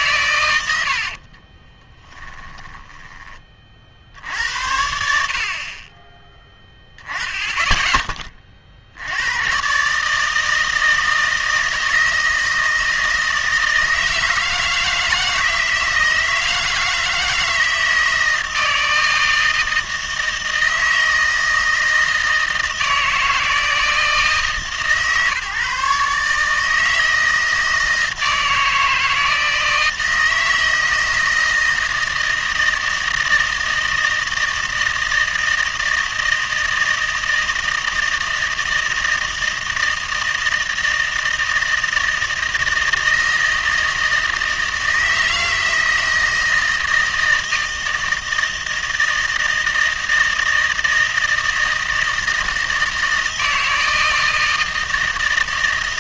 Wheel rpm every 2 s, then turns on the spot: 100, 10, 70, 10, 50, 160, 160, 160, 160, 160, 160, 160, 140, 150, 160, 160, 160, 160, 160, 160, 160, 160, 160, 160, 160, 160, 160, 160.
2-4